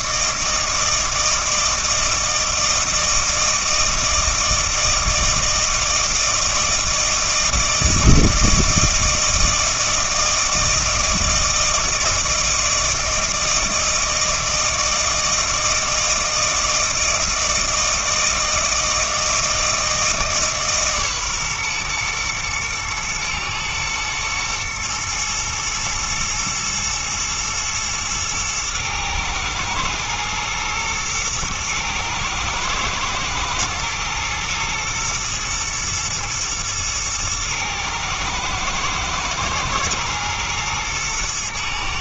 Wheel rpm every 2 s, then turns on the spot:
160, 160, 160, 160, 160, 160, 160, 160, 160, 160, 140, 110, 110, 110, 110, 110, 110, 110, 120, 110, 110.
none